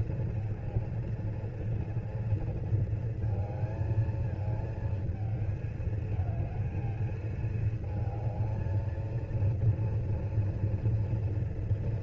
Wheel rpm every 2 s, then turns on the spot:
230, 230, 220, 220, 220, 240.
none